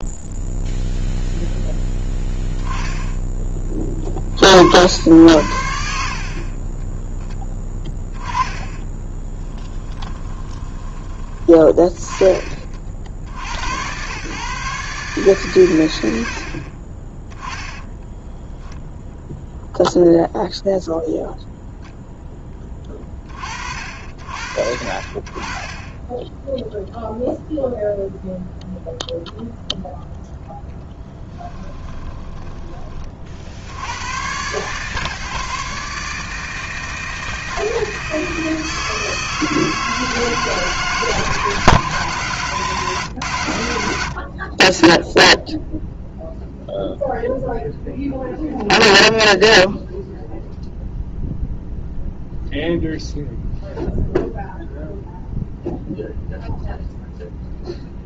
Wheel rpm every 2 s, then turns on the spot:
0, 10, 70, 30, 20, 20, 30, 140, 50, 10, 0, 10, 60, 0, 0, 0, 20, 120, 160, 160, 160, 160, 50, 0, 0, 0, 0, 0, 0.
8-10 32-34